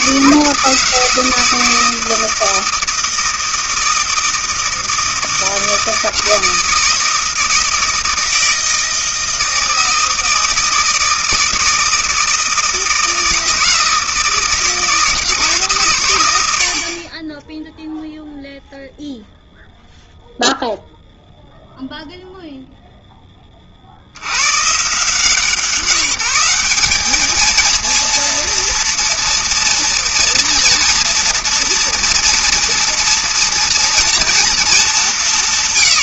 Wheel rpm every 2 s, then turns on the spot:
160, 160, 160, 160, 160, 160, 160, 160, 70, 0, 0, 0, 100, 190, 230, 240, 230, 230.
none